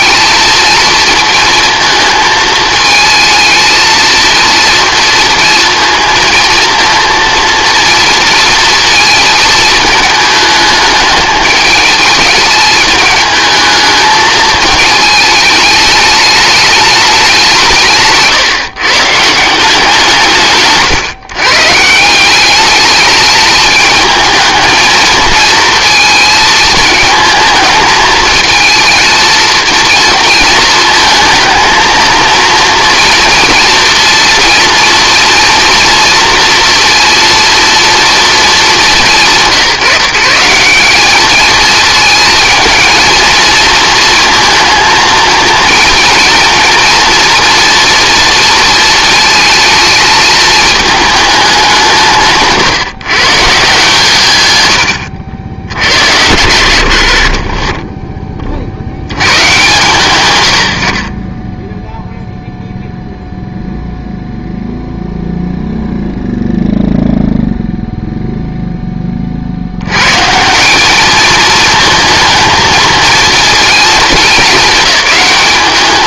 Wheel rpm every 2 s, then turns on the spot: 220, 220, 230, 230, 230, 210, 210, 220, 210, 140, 140, 210, 220, 220, 230, 230, 230, 230, 230, 200, 190, 220, 220, 230, 230, 220, 140, 110, 80, 70, 50, 0, 0, 0, 10, 200, 230, 210.
none